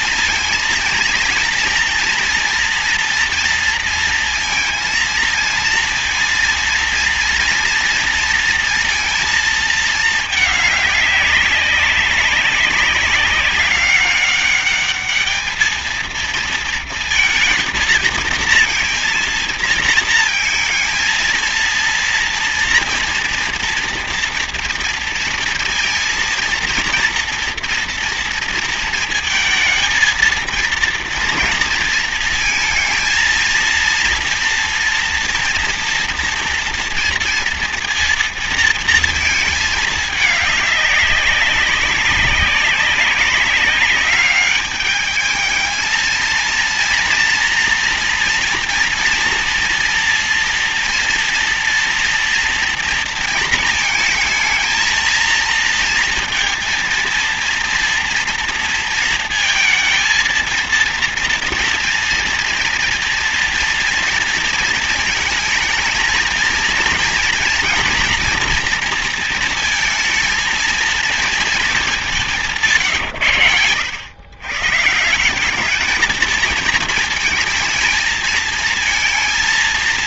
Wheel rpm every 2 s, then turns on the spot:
230, 230, 230, 230, 230, 210, 190, 210, 230, 230, 220, 230, 230, 230, 230, 230, 230, 230, 230, 230, 200, 190, 210, 230, 240, 230, 230, 230, 230, 230, 230, 230, 230, 230, 230, 220, 150, 150, 230, 230.
none